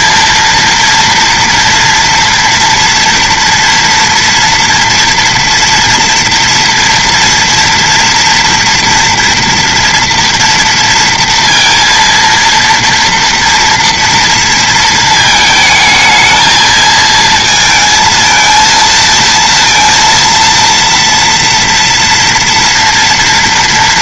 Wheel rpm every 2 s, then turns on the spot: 230, 230, 230, 230, 230, 230, 230, 230, 220, 220, 230, 230.
none